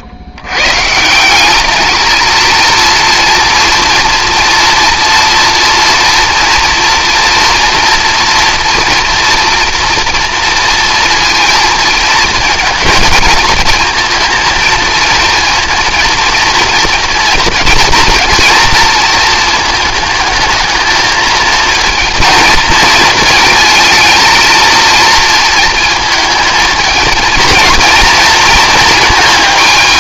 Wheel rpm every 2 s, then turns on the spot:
130, 230, 240, 230, 230, 230, 230, 230, 230, 230, 220, 230, 220, 220, 230.
none